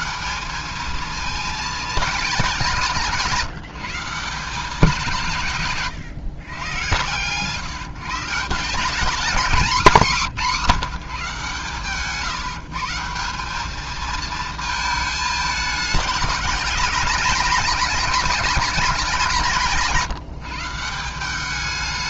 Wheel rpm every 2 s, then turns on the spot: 210, 170, 180, 110, 190, 200, 160, 220, 200, 200, 170.
none